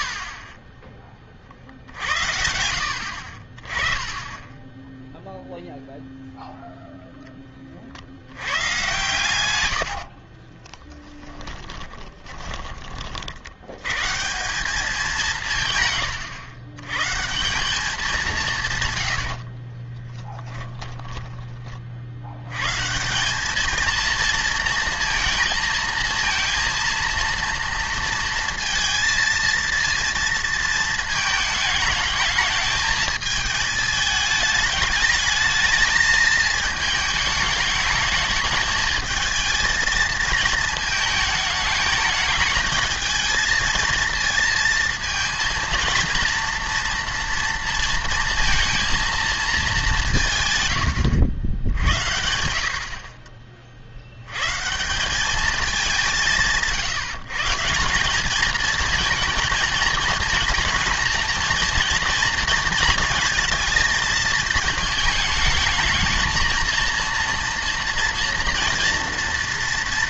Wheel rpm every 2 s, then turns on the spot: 10, 60, 10, 0, 120, 10, 50, 190, 140, 110, 10, 170, 230, 230, 230, 220, 220, 210, 220, 220, 210, 220, 230, 230, 230, 100, 50, 160, 160, 220, 230, 230, 220, 230, 230.
0-2 10-12 18-22